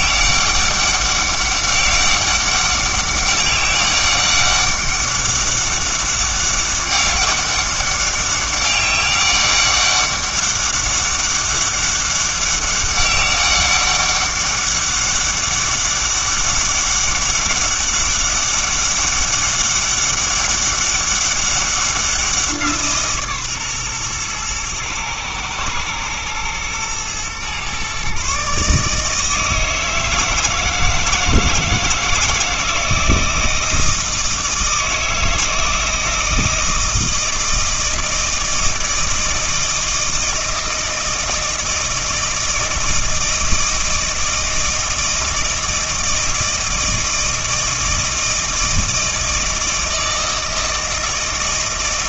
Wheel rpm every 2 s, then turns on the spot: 200, 200, 200, 200, 200, 200, 200, 200, 200, 200, 200, 160, 120, 120, 150, 160, 160, 160, 160, 160, 160, 160, 160, 160, 160, 160.
none